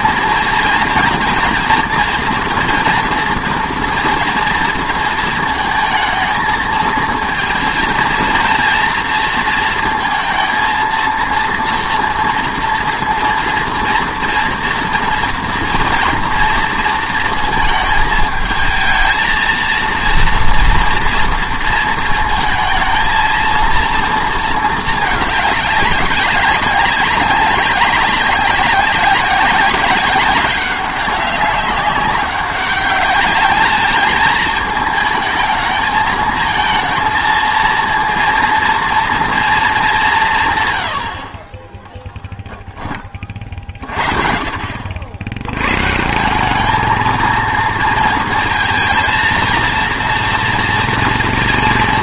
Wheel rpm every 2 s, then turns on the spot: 220, 230, 230, 220, 230, 230, 240, 230, 230, 220, 230, 220, 220, 200, 190, 190, 200, 220, 230, 230, 130, 10, 60, 210, 220, 230.
none